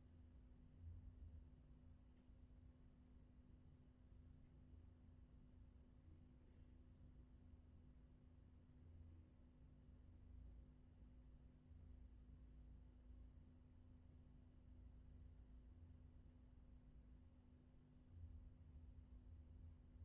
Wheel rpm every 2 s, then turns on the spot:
0, 0, 0, 0, 0, 0, 0, 0, 0, 0.
none